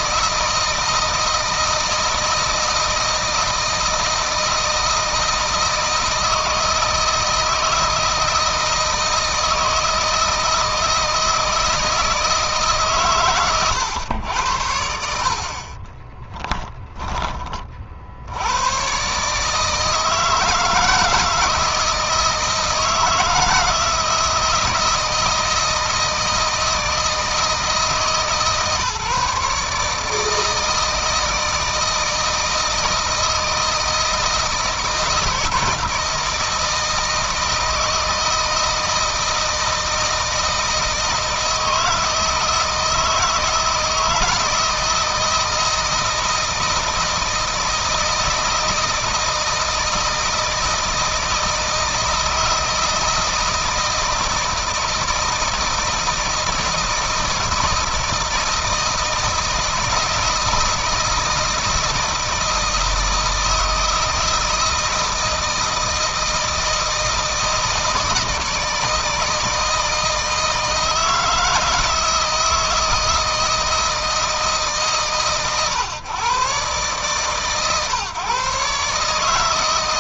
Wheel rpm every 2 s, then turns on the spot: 160, 160, 160, 160, 160, 160, 140, 70, 10, 110, 160, 160, 160, 160, 140, 160, 160, 160, 160, 160, 160, 160, 160, 160, 160, 170, 160, 160, 160, 160, 160, 160, 160, 160, 160, 160, 160, 140, 130, 140.
none